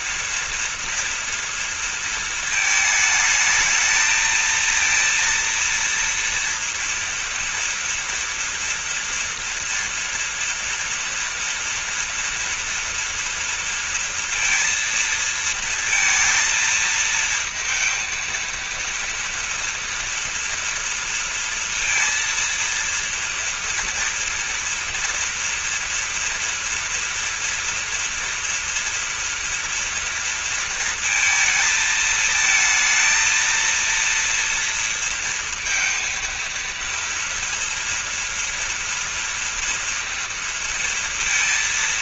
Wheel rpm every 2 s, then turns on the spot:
230, 220, 230, 230, 230, 230, 230, 230, 230, 230, 230, 230, 230, 240, 230, 230, 220, 230, 230, 230, 230.
none